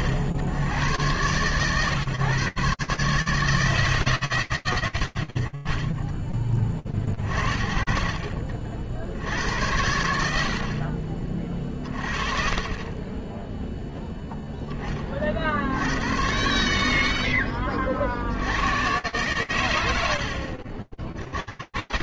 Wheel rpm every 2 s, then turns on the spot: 80, 140, 60, 40, 70, 30, 0, 70, 50, 100, 100.
none